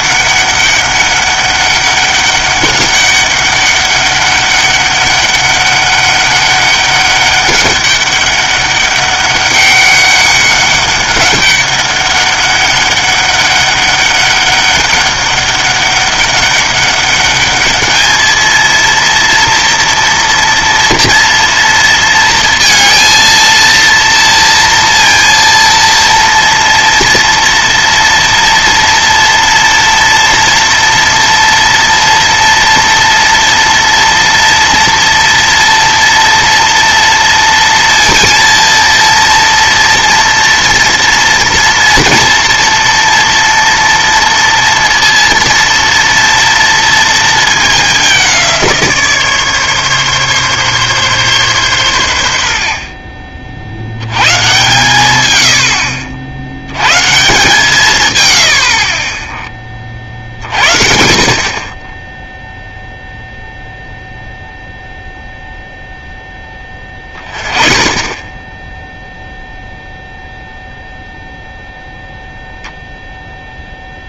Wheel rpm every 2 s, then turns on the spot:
200, 200, 200, 200, 200, 200, 200, 200, 200, 230, 230, 230, 230, 230, 230, 230, 230, 230, 230, 230, 230, 230, 230, 230, 170, 140, 70, 110, 80, 70, 60, 0, 0, 10, 10, 0, 0.
none